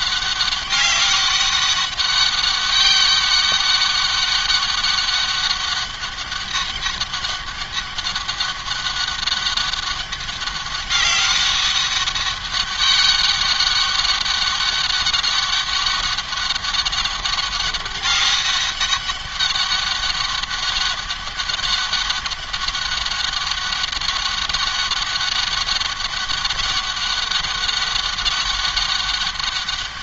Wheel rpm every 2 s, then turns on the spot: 200, 200, 200, 200, 200, 200, 200, 200, 200, 200, 200, 200, 200, 190, 200.
none